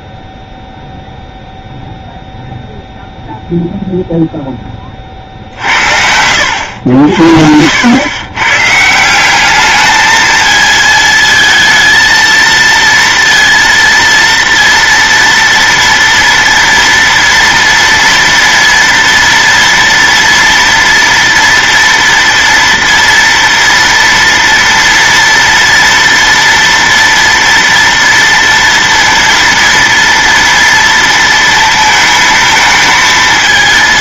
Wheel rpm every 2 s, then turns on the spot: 0, 0, 10, 80, 150, 220, 230, 230, 230, 230, 230, 230, 230, 230, 230, 230, 220.
none